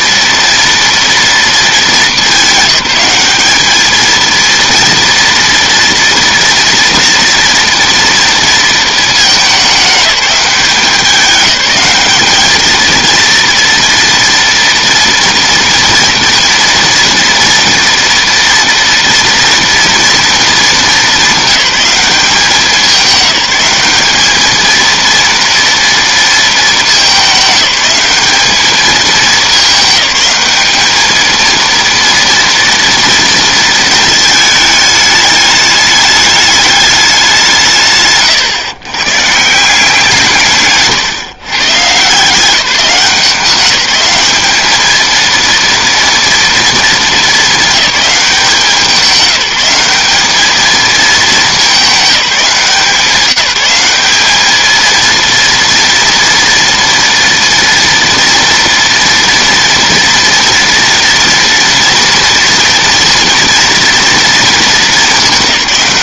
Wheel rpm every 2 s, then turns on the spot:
230, 200, 230, 230, 220, 190, 230, 230, 240, 230, 210, 200, 230, 210, 210, 220, 230, 210, 190, 130, 140, 180, 220, 230, 180, 210, 180, 230, 230, 230, 230, 240, 210.
none